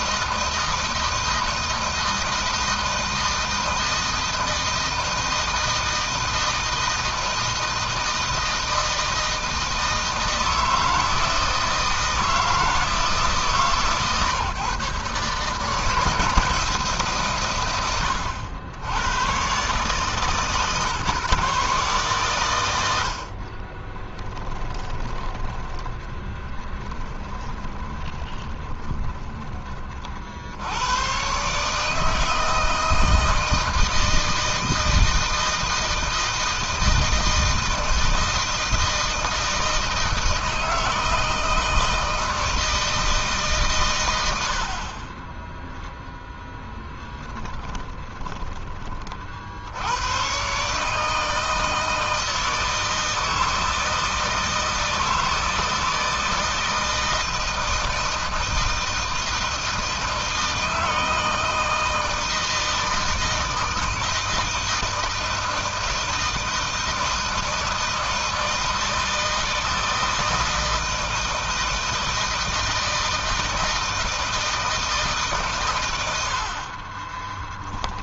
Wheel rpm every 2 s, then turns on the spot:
160, 160, 160, 160, 160, 160, 160, 120, 150, 80, 140, 120, 10, 10, 10, 70, 160, 160, 160, 160, 160, 160, 60, 10, 20, 130, 160, 160, 160, 160, 160, 160, 160, 160, 160, 160, 160, 160, 50.
24-30 46-48 76-78